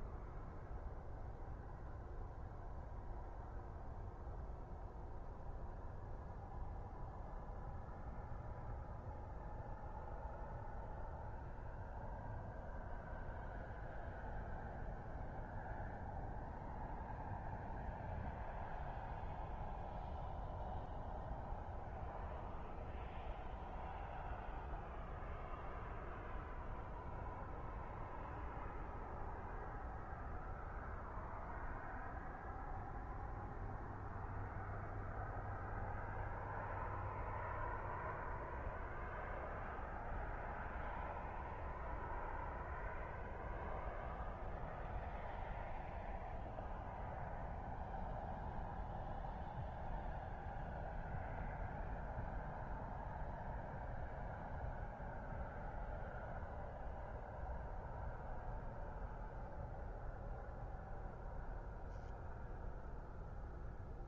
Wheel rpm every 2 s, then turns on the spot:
0, 0, 0, 0, 0, 0, 0, 0, 0, 0, 0, 0, 0, 0, 0, 0, 0, 0, 0, 0, 0, 0, 0, 0, 0, 0, 0, 0, 0, 0, 0, 0.
none